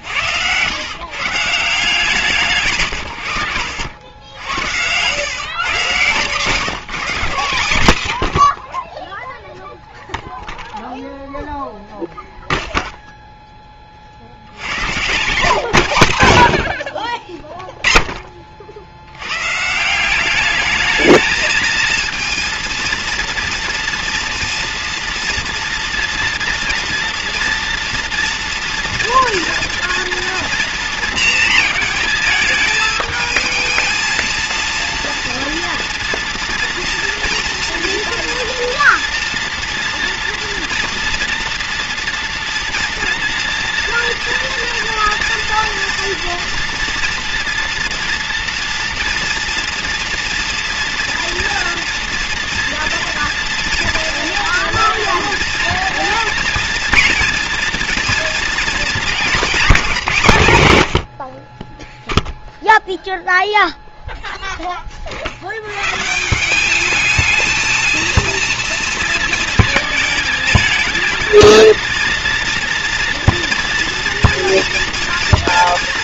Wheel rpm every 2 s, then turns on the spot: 110, 140, 90, 150, 40, 0, 0, 100, 70, 60, 210, 230, 230, 240, 230, 230, 220, 230, 230, 230, 230, 230, 230, 230, 230, 230, 230, 230, 230, 220, 110, 10, 20, 200, 230, 220, 230, 230.
8-10 14-16